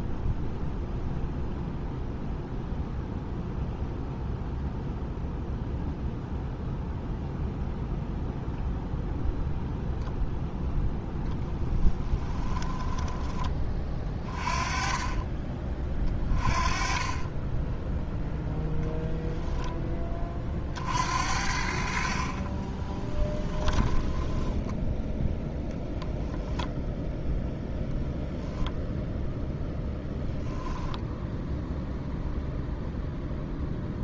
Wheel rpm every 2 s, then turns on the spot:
0, 0, 0, 0, 0, 0, 10, 20, 30, 0, 50, 20, 10, 0, 0, 0, 0.
12-14 22-24